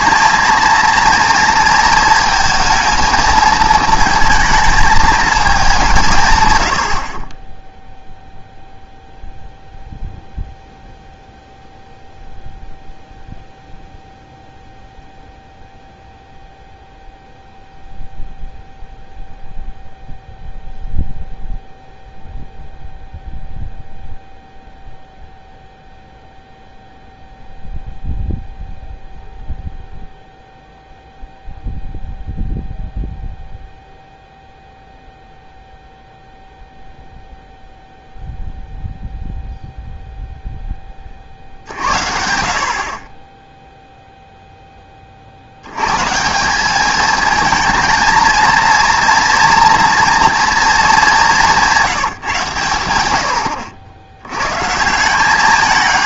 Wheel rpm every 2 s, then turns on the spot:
230, 230, 220, 110, 0, 0, 0, 0, 0, 0, 0, 0, 0, 0, 0, 0, 0, 0, 0, 0, 10, 60, 10, 190, 230, 220, 130, 130.
none